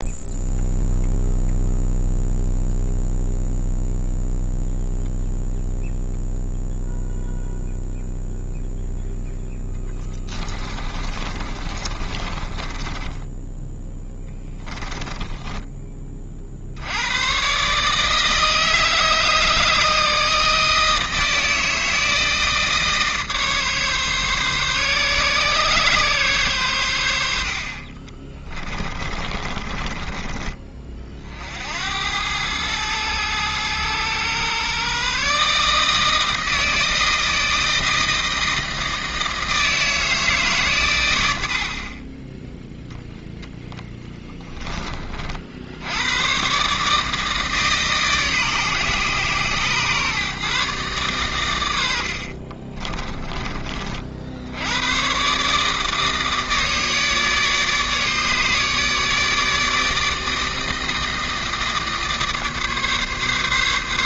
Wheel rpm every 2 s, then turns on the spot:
0, 0, 0, 0, 0, 30, 20, 10, 120, 160, 160, 150, 140, 70, 30, 50, 110, 140, 160, 160, 90, 10, 40, 150, 130, 120, 30, 130, 150, 150, 160, 140.
10-16 28-30 52-54